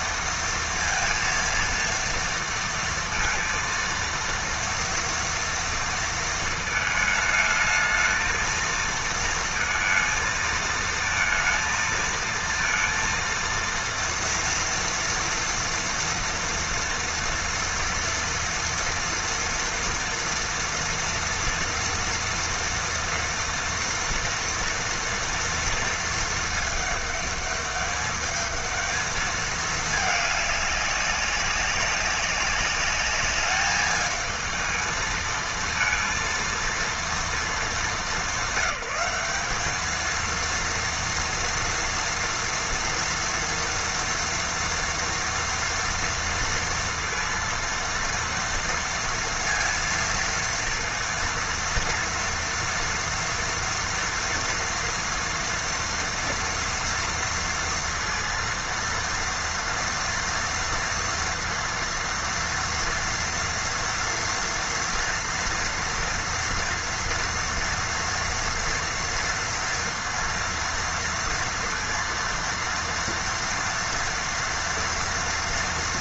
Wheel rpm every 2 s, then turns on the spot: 230, 230, 230, 220, 230, 230, 230, 230, 230, 230, 240, 230, 230, 220, 220, 200, 200, 220, 230, 200, 230, 230, 230, 230, 230, 230, 230, 230, 240, 230, 230, 230, 230, 230, 230, 230, 230, 240.
none